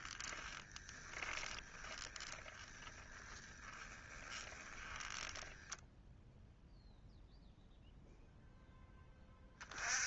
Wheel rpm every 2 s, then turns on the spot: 10, 10, 20, 0, 10.
0-6